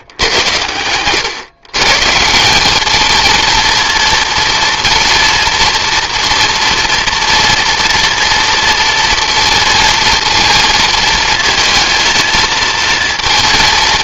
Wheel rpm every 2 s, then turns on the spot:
100, 190, 240, 230, 230, 230, 230.
none